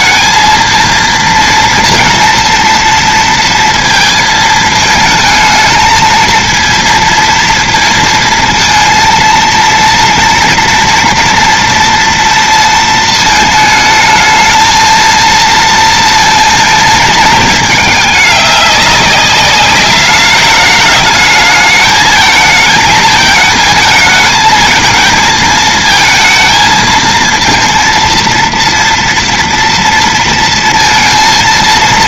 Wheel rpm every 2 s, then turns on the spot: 230, 230, 220, 230, 230, 230, 230, 220, 220, 200, 210, 220, 220, 220, 230, 230.
none